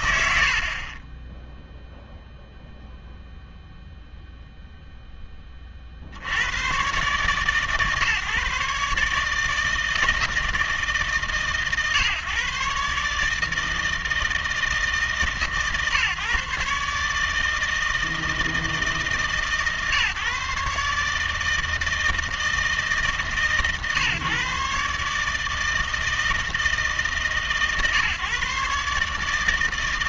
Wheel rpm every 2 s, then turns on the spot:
80, 0, 0, 120, 150, 150, 140, 160, 150, 160, 150, 150, 150, 150, 140.
none